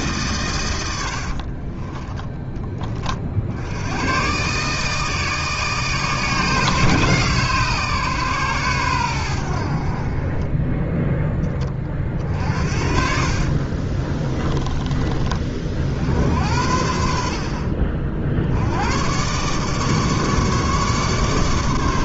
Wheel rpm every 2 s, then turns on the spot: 90, 30, 150, 150, 110, 10, 60, 30, 70, 100, 150.
0-2 12-14